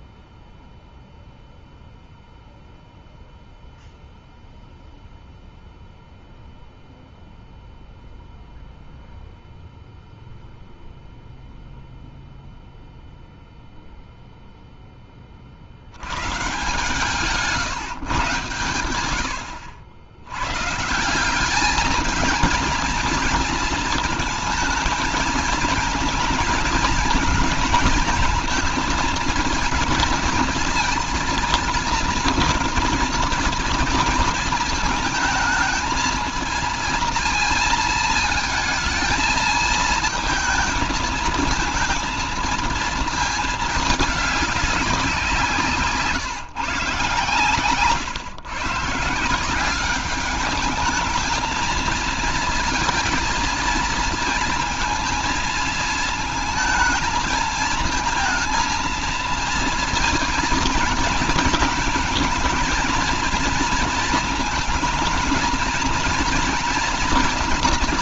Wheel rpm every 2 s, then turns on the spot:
0, 0, 0, 0, 0, 0, 0, 0, 150, 130, 130, 220, 220, 220, 220, 230, 230, 220, 230, 220, 220, 230, 200, 150, 140, 210, 220, 230, 220, 230, 230, 220, 220, 240.
none